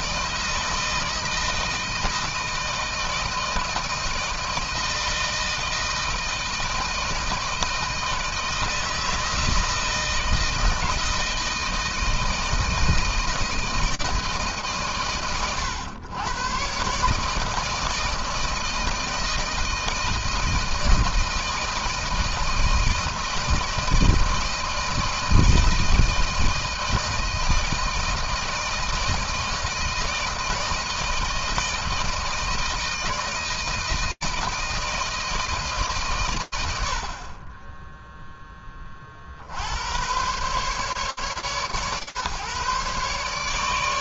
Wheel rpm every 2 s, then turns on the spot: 160, 160, 160, 160, 160, 160, 160, 140, 120, 160, 160, 160, 160, 160, 160, 160, 160, 160, 80, 20, 130, 130.
none